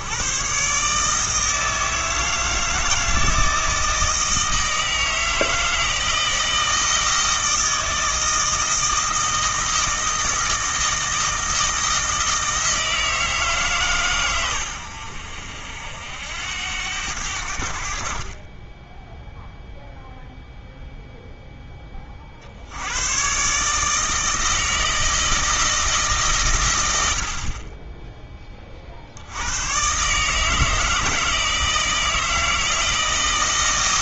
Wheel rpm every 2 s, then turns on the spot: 140, 160, 160, 160, 160, 160, 160, 90, 90, 10, 0, 70, 160, 110, 30, 160, 160.
none